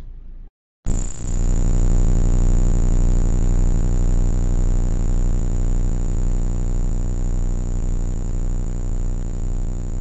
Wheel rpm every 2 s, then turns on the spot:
0, 0, 0, 0, 0.
none